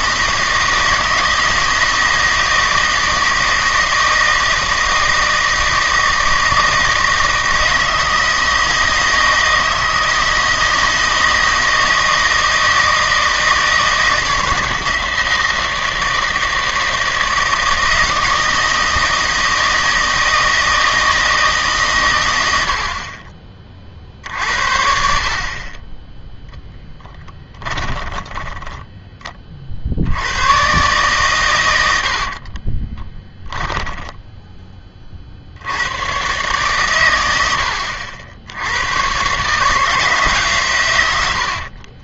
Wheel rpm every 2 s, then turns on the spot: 160, 160, 160, 160, 160, 160, 160, 160, 160, 160, 160, 60, 60, 0, 10, 130, 20, 30, 120, 100, 110.
32-34